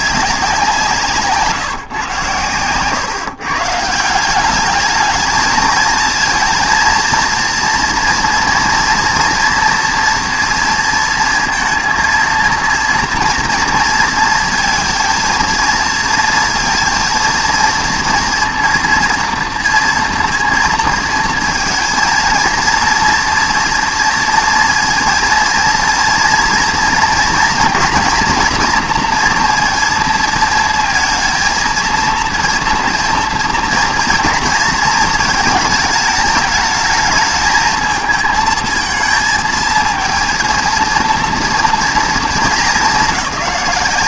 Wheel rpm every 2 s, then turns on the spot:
180, 120, 200, 230, 230, 230, 230, 230, 230, 230, 230, 230, 230, 230, 230, 230, 230, 220, 210, 220, 230, 220.
none